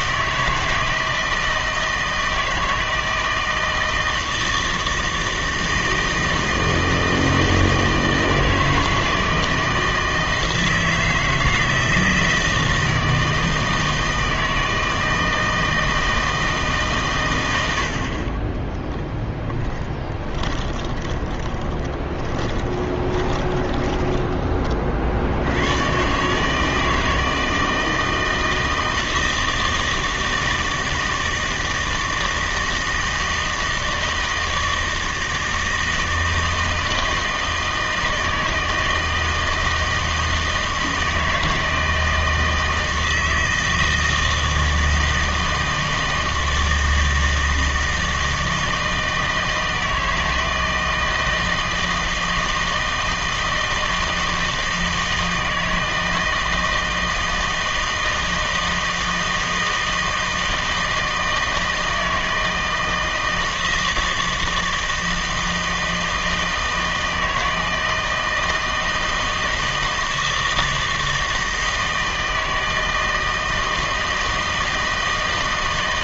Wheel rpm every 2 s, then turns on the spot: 160, 160, 160, 160, 160, 160, 160, 160, 150, 20, 20, 20, 30, 160, 160, 160, 160, 160, 160, 160, 160, 160, 160, 160, 160, 160, 160, 160, 160, 160, 160, 160, 160, 160, 160, 160, 160, 160.
18-24